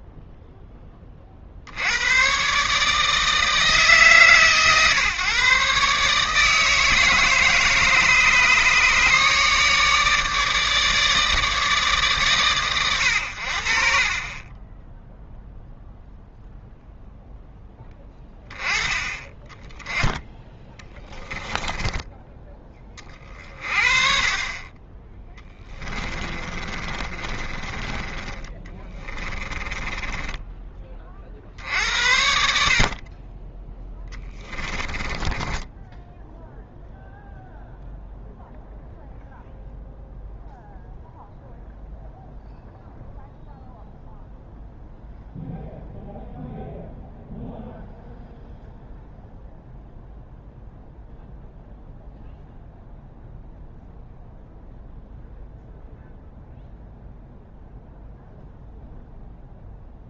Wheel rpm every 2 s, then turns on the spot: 20, 150, 130, 160, 150, 150, 100, 20, 0, 20, 10, 20, 30, 30, 20, 20, 60, 20, 0, 0, 0, 0, 0, 0, 0, 0, 0, 0, 0, 0.
20-22 26-30 34-36